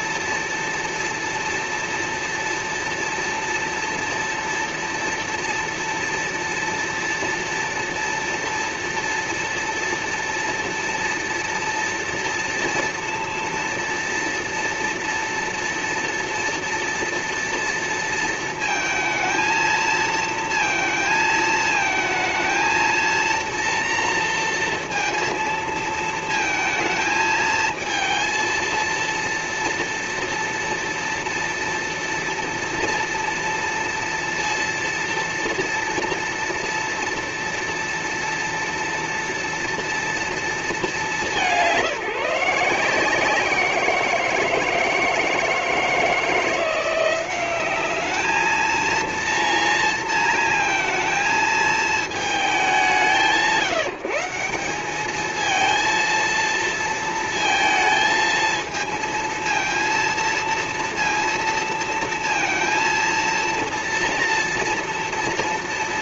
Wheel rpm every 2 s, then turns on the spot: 230, 230, 230, 230, 230, 230, 230, 230, 230, 230, 230, 220, 230, 220, 230, 230, 230, 230, 230, 230, 230, 170, 160, 170, 220, 230, 210, 170, 230, 220, 230, 230, 230.
none